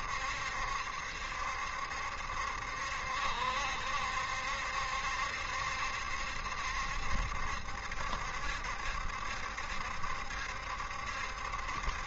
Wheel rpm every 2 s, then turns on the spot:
70, 70, 70, 70, 70, 70.
none